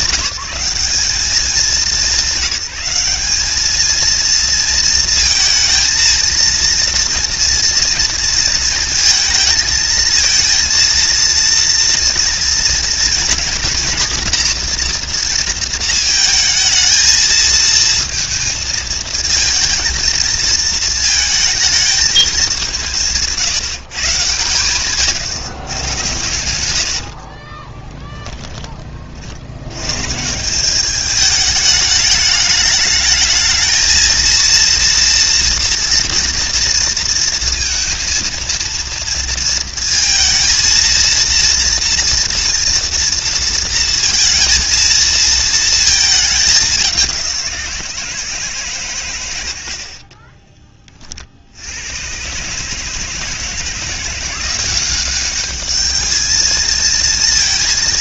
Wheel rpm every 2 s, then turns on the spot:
190, 190, 230, 230, 230, 230, 230, 230, 220, 230, 230, 200, 140, 100, 10, 180, 210, 230, 230, 230, 230, 230, 230, 210, 150, 20, 140, 180, 220.
26-28